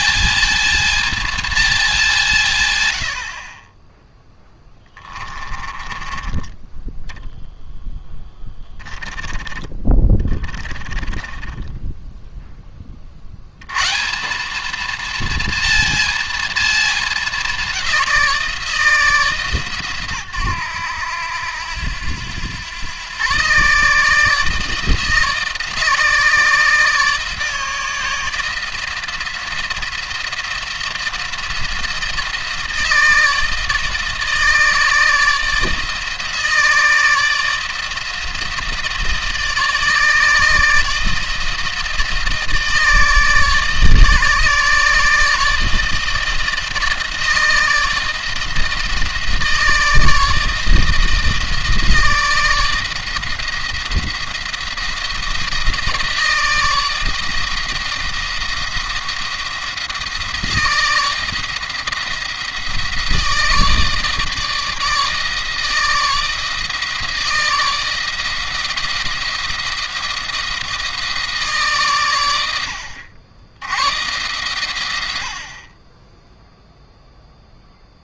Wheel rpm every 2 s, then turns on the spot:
220, 100, 10, 20, 10, 40, 20, 200, 220, 170, 110, 100, 150, 160, 170, 170, 160, 160, 160, 160, 160, 160, 150, 160, 160, 160, 160, 170, 160, 170, 160, 170, 140, 160, 160, 160, 90, 110, 0.
4-6 8-12